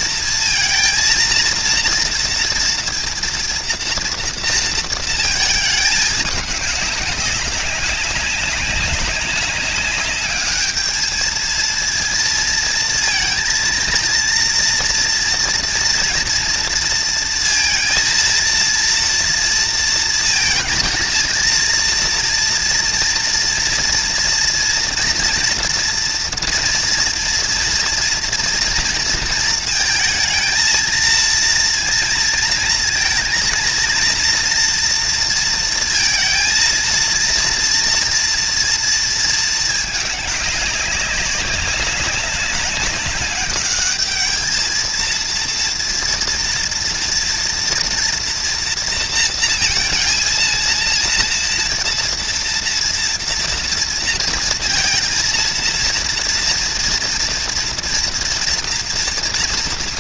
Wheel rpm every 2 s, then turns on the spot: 230, 230, 230, 210, 200, 210, 230, 230, 230, 230, 220, 230, 230, 230, 230, 220, 220, 230, 230, 230, 200, 200, 220, 230, 230, 230, 230, 230, 230, 230.
none